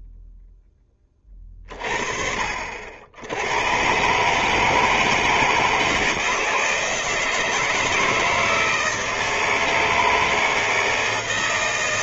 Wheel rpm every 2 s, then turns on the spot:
0, 40, 140, 160, 160, 160.
none